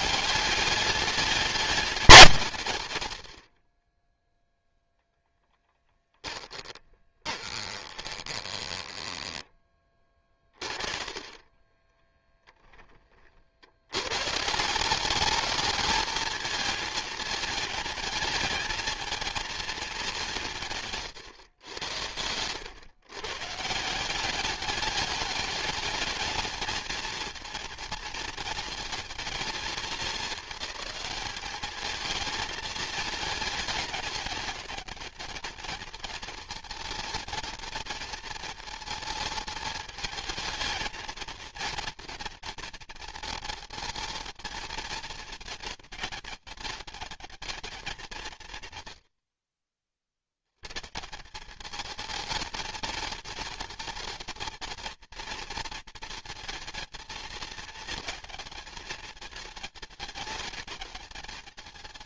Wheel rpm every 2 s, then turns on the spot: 200, 140, 0, 20, 10, 30, 10, 190, 220, 220, 150, 110, 200, 220, 220, 210, 220, 210, 230, 220, 220, 230, 220, 210, 100, 130, 220, 230, 230, 220, 210.
6-12